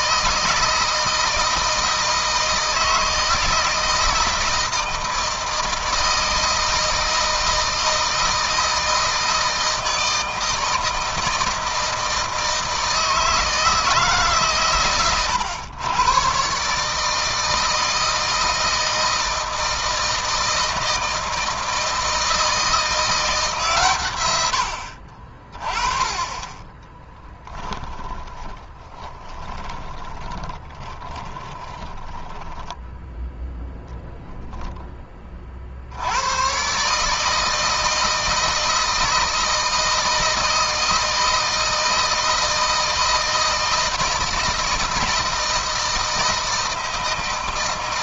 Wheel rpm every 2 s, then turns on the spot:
160, 160, 160, 160, 160, 160, 160, 150, 140, 160, 160, 160, 80, 20, 30, 20, 10, 0, 120, 160, 160, 160, 160, 160.
26-34